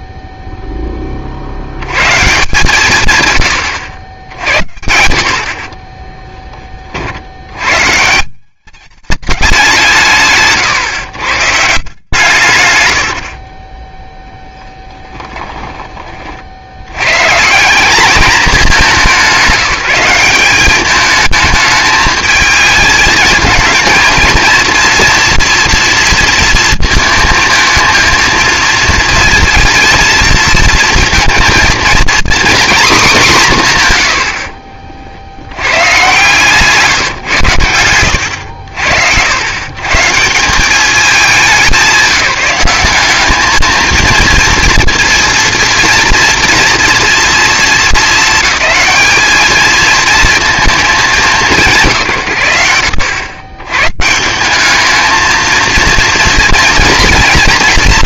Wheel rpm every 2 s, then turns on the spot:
10, 140, 80, 30, 200, 140, 130, 10, 90, 210, 200, 220, 230, 230, 230, 230, 250, 60, 150, 80, 190, 190, 230, 230, 220, 220, 110, 210, 230.
14-16 34-38